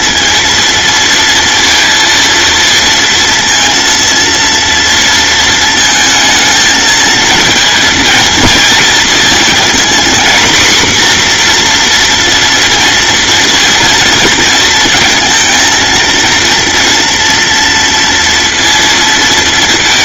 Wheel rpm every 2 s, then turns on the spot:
230, 230, 230, 220, 220, 240, 230, 230, 230, 230.
none